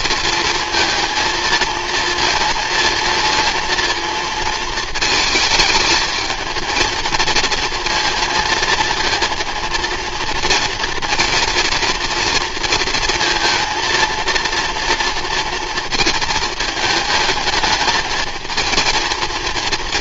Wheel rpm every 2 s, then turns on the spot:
230, 230, 230, 220, 230, 230, 230, 230, 220, 230.
none